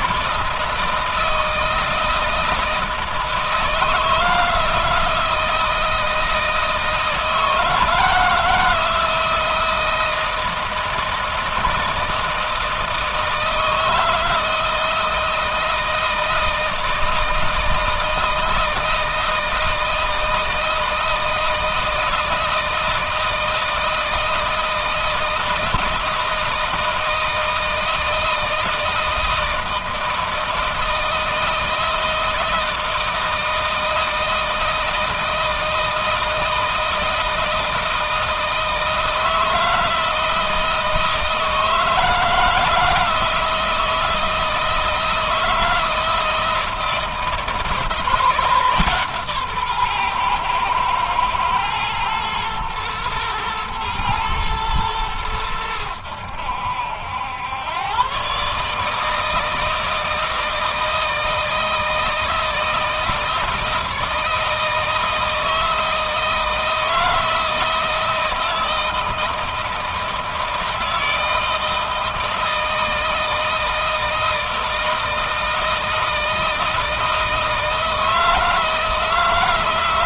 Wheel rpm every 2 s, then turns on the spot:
160, 160, 160, 160, 160, 160, 160, 160, 160, 160, 160, 160, 160, 160, 160, 160, 160, 160, 160, 160, 160, 160, 160, 160, 160, 120, 120, 110, 80, 140, 160, 160, 160, 160, 160, 160, 160, 160, 160, 160.
none